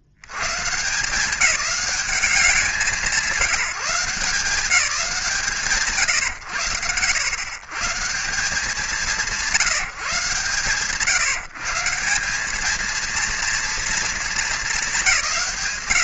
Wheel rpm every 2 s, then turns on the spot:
90, 190, 160, 130, 160, 150, 190, 220.
none